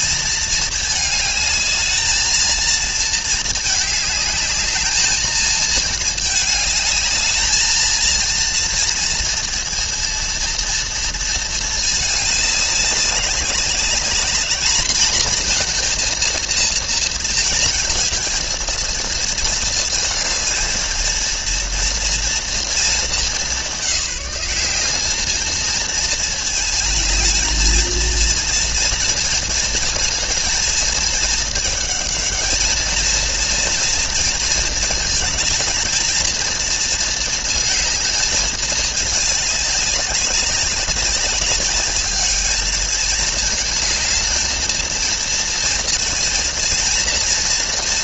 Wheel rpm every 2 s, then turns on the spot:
220, 220, 220, 220, 230, 230, 200, 230, 230, 230, 230, 210, 220, 220, 230, 220, 220, 220, 220, 210, 200, 220, 230, 230.
none